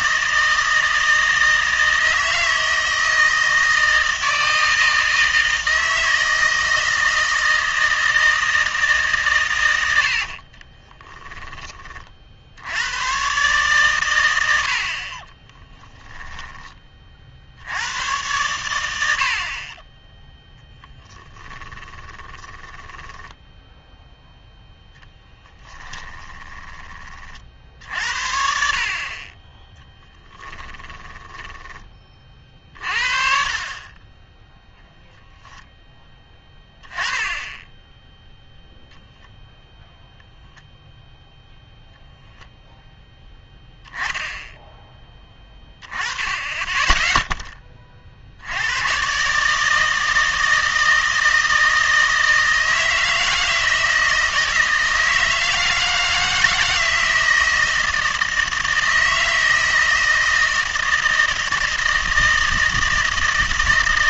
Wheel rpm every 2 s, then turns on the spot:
160, 160, 160, 160, 160, 30, 80, 60, 20, 90, 10, 10, 0, 20, 50, 20, 40, 0, 10, 0, 0, 0, 10, 10, 110, 160, 160, 160, 160, 160, 160, 160.
10-12 20-24 26-28 30-32